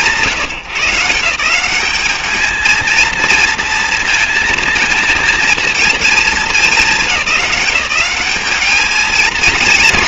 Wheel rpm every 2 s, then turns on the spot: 170, 220, 220, 200, 210.
none